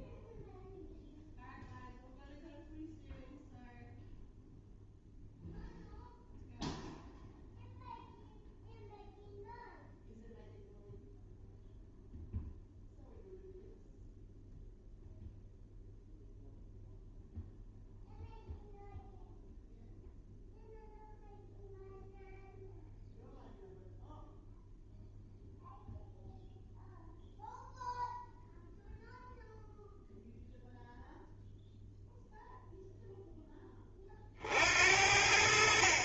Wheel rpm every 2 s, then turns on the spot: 0, 0, 0, 0, 0, 0, 0, 0, 0, 0, 0, 0, 0, 0, 0, 0, 0, 70.
none